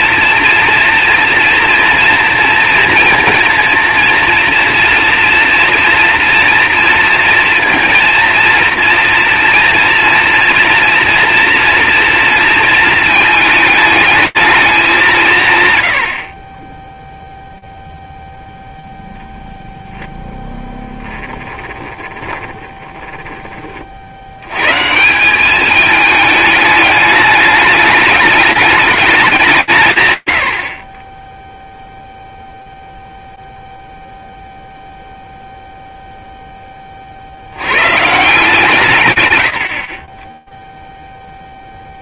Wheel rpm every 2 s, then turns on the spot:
230, 240, 240, 230, 230, 230, 230, 220, 100, 0, 0, 20, 110, 210, 220, 60, 0, 0, 50, 130, 0.
22-24